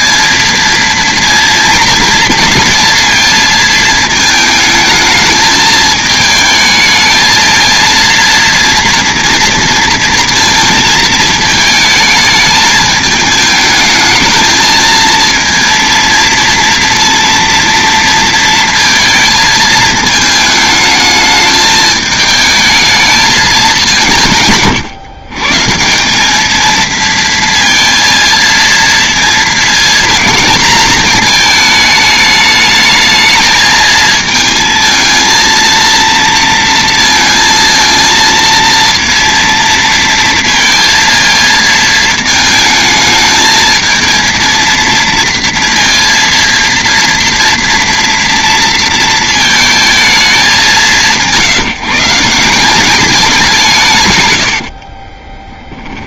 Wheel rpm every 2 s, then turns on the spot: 230, 230, 220, 220, 230, 230, 210, 220, 230, 230, 220, 220, 130, 220, 230, 220, 210, 220, 230, 230, 230, 220, 230, 230, 230, 200, 190, 90.
54-56